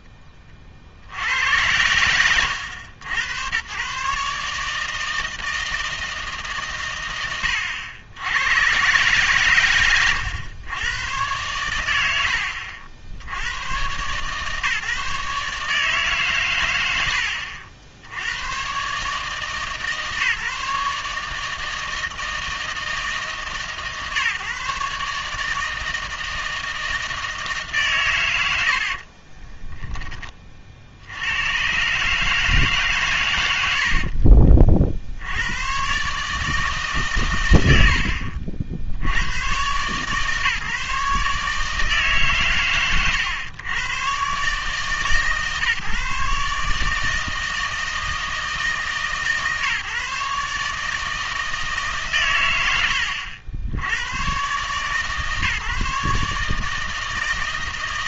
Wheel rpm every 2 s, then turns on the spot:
30, 80, 150, 140, 110, 110, 70, 150, 110, 120, 150, 160, 140, 160, 90, 40, 150, 50, 150, 70, 140, 130, 140, 150, 160, 150, 110, 120, 150.
none